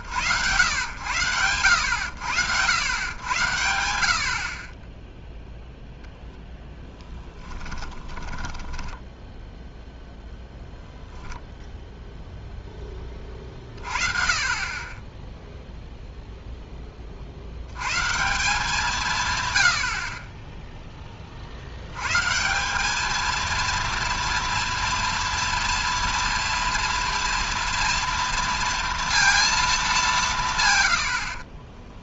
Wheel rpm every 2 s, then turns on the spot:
100, 0, 10, 10, 0, 10, 20, 0, 170, 10, 140, 230, 230, 230, 180, 20.
4-8 30-32